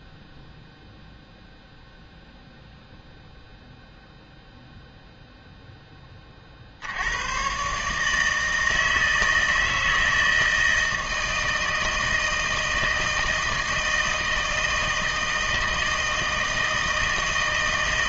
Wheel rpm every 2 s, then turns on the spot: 0, 0, 0, 50, 160, 160, 160, 160, 160.
none